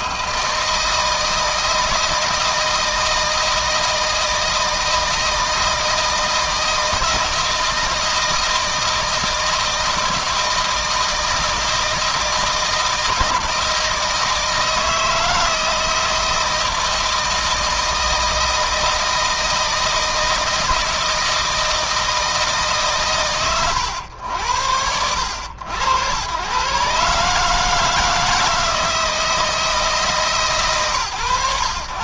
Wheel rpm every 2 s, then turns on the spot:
160, 160, 160, 160, 160, 160, 160, 160, 160, 160, 160, 140, 80, 130, 160, 160.
none